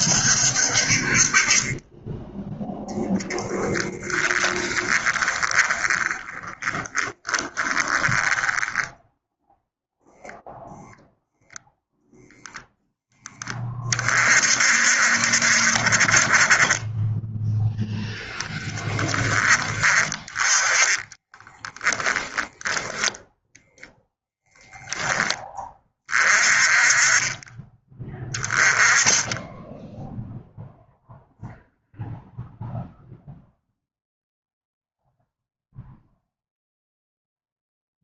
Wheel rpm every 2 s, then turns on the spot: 50, 10, 20, 20, 10, 0, 0, 60, 20, 10, 20, 20, 10, 30, 20, 0, 0, 0, 0.
4-10 20-24